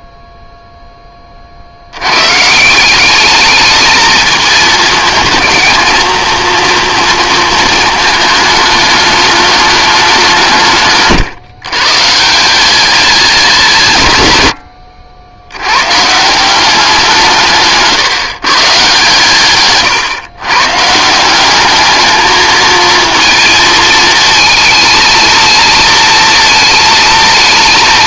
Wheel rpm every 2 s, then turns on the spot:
0, 170, 220, 230, 210, 160, 190, 80, 180, 140, 140, 230, 220, 220.
14-16